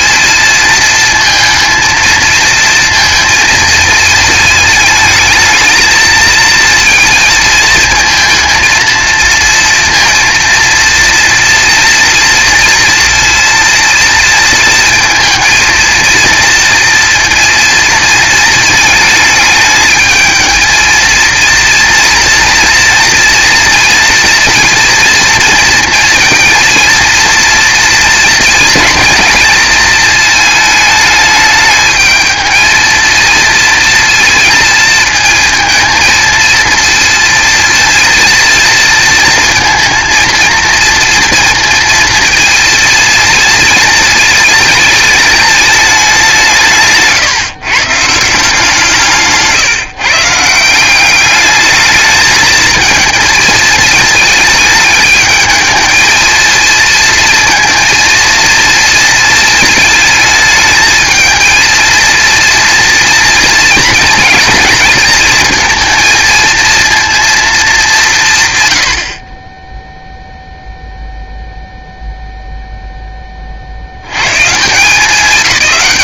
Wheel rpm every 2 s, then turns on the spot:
220, 230, 220, 230, 230, 230, 230, 230, 230, 220, 220, 230, 230, 230, 230, 220, 230, 220, 230, 220, 230, 230, 220, 150, 170, 190, 220, 210, 230, 230, 220, 230, 220, 230, 90, 0, 10, 180.
none